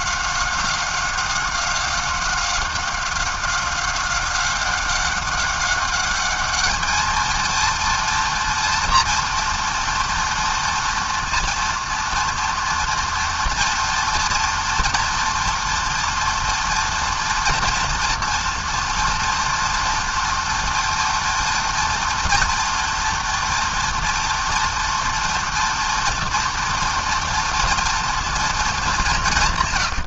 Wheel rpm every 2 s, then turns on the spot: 190, 190, 190, 230, 240, 230, 230, 230, 230, 230, 230, 230, 230, 230, 150.
none